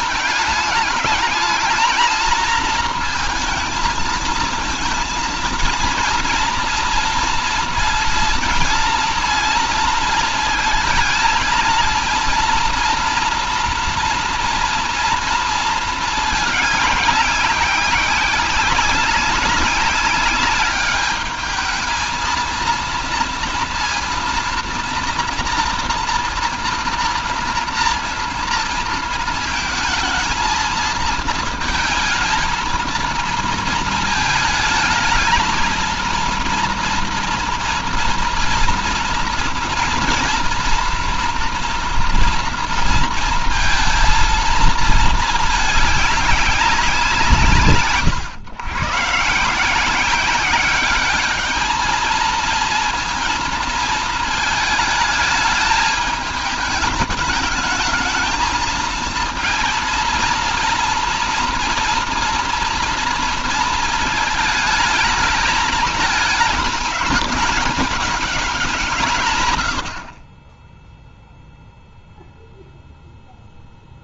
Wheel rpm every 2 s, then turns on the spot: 210, 230, 230, 230, 230, 220, 230, 230, 210, 200, 210, 230, 230, 240, 230, 230, 230, 220, 240, 230, 230, 230, 220, 180, 130, 200, 230, 220, 210, 220, 230, 230, 220, 220, 180, 20, 0.
none